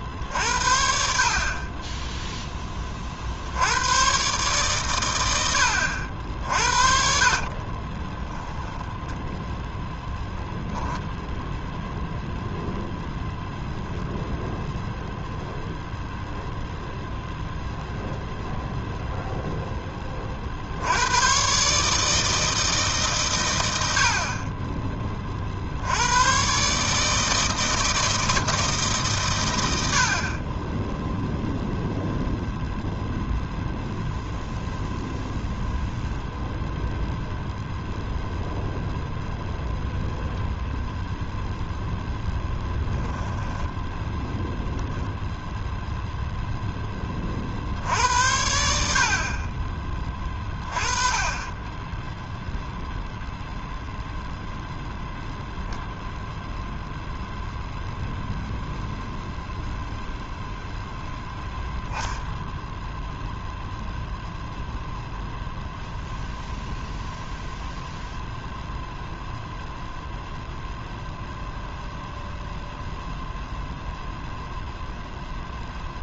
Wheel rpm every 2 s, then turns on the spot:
10, 110, 70, 40, 10, 0, 0, 0, 0, 0, 110, 120, 30, 160, 130, 0, 0, 0, 0, 0, 0, 10, 0, 10, 60, 20, 0, 0, 0, 0, 0, 0, 0, 0, 0, 0, 0, 0.
6-10 42-44